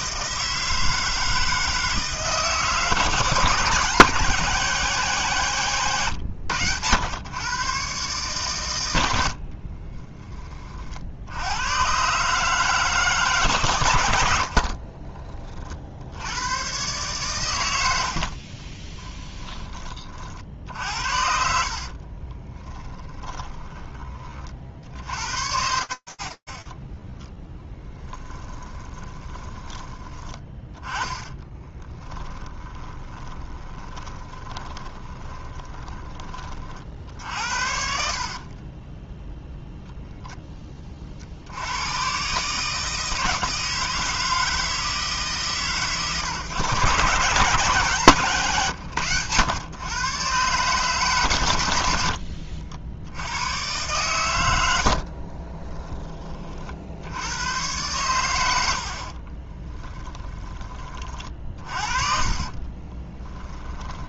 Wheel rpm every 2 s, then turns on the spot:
160, 160, 170, 100, 120, 40, 150, 50, 110, 40, 60, 20, 50, 20, 20, 10, 20, 20, 50, 10, 40, 160, 150, 140, 120, 130, 80, 60, 50, 40, 30, 20.
14-16 18-20 22-24 26-36 38-40 54-56 58-60 62-64